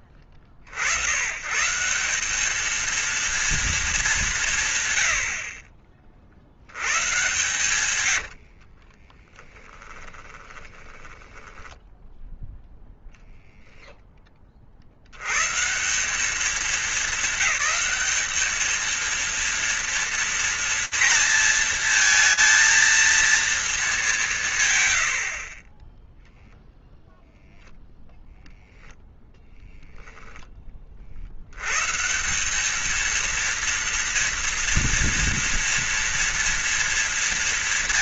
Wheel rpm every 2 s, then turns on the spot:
40, 220, 120, 100, 50, 10, 0, 20, 200, 210, 230, 230, 150, 0, 0, 20, 200, 230, 230.
8-12